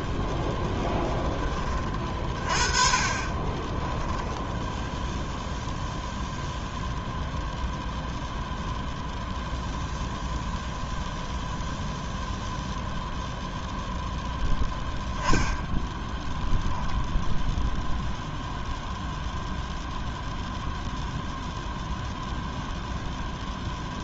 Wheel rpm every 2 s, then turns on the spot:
0, 30, 0, 0, 0, 0, 0, 0, 10, 0, 0, 0.
16-18